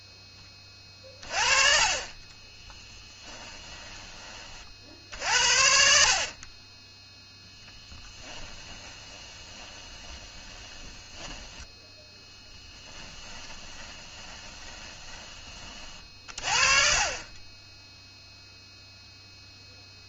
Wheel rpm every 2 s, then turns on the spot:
20, 30, 40, 30, 20, 20, 20, 20, 30, 0.
2-4 8-16